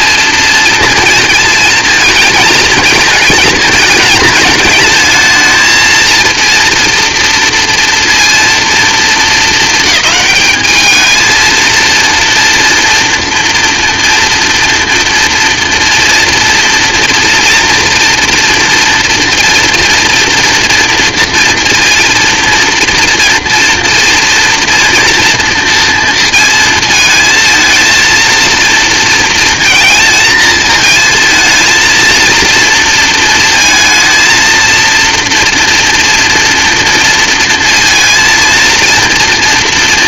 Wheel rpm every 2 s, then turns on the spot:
230, 220, 220, 230, 230, 220, 230, 230, 230, 230, 230, 230, 230, 230, 230, 220, 230, 230, 230, 230.
none